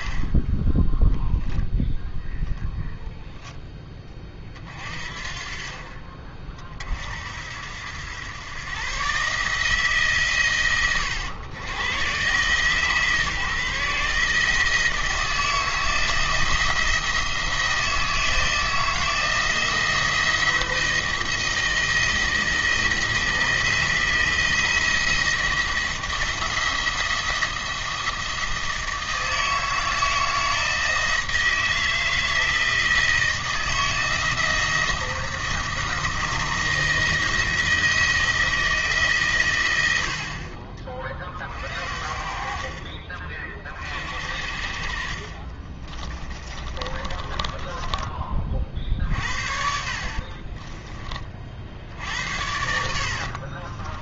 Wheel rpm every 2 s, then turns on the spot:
10, 0, 40, 50, 130, 110, 140, 160, 170, 160, 170, 160, 170, 170, 160, 160, 160, 160, 160, 160, 40, 50, 60, 30, 40, 30, 80.
46-52